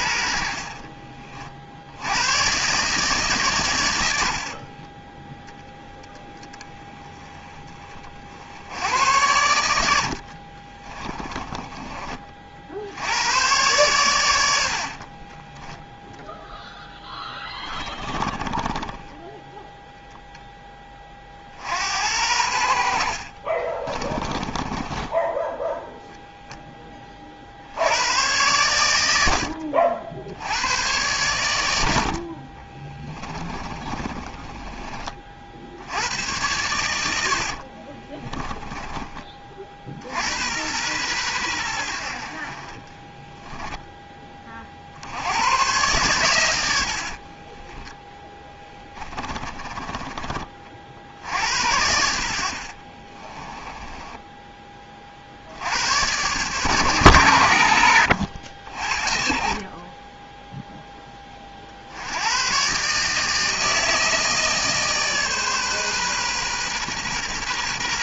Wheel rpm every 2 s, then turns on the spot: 50, 140, 30, 20, 70, 30, 70, 70, 10, 10, 20, 70, 20, 10, 100, 100, 20, 30, 90, 20, 110, 40, 40, 90, 10, 50, 40, 30, 110, 60, 10, 140, 150, 130.
0-2 4-6 10-12 14-16 18-20 24-26 32-36 38-40 46-50 52-54